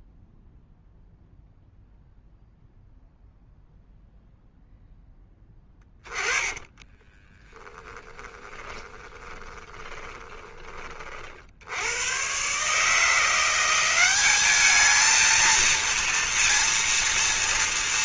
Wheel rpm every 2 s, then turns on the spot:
0, 0, 10, 30, 20, 30, 150, 220, 230.
6-10